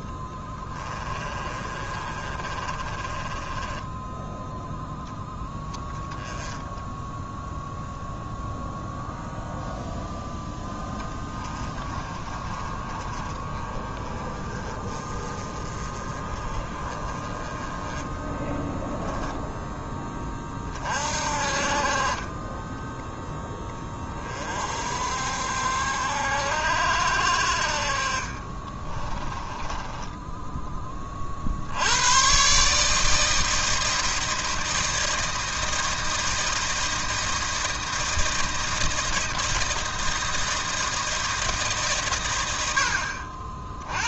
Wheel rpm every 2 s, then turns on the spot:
20, 20, 0, 10, 0, 20, 30, 30, 20, 0, 40, 10, 60, 60, 20, 30, 160, 160, 160, 160, 160, 60.
0-4 6-8 28-30